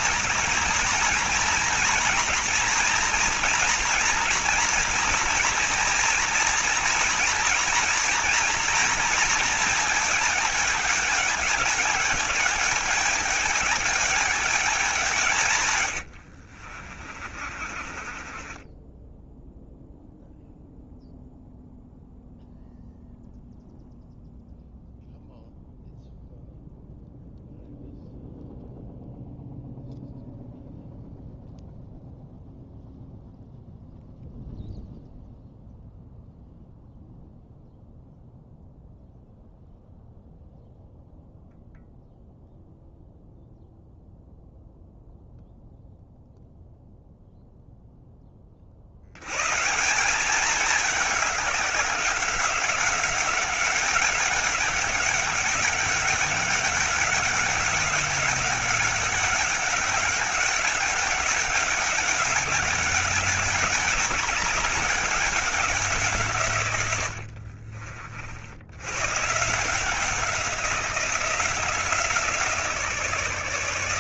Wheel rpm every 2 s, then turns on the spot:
230, 230, 240, 230, 230, 210, 210, 190, 50, 20, 0, 0, 0, 0, 0, 0, 0, 0, 0, 0, 0, 0, 0, 0, 50, 200, 190, 200, 200, 200, 200, 200, 200, 130, 90, 180, 160.
16-20